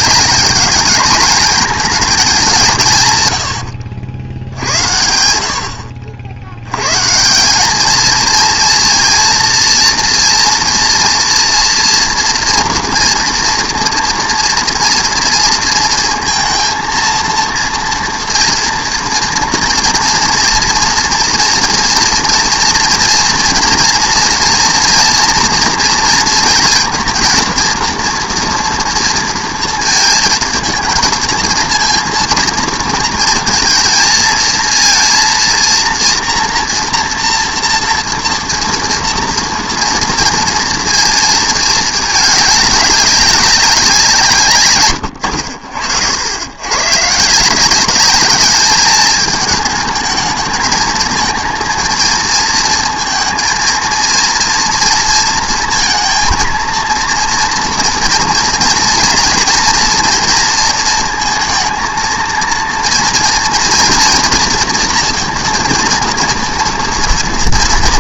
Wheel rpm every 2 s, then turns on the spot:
210, 180, 80, 90, 230, 230, 230, 230, 230, 240, 230, 230, 230, 230, 240, 220, 230, 220, 230, 230, 230, 200, 140, 90, 200, 220, 220, 240, 230, 230, 230, 230, 230, 230.
none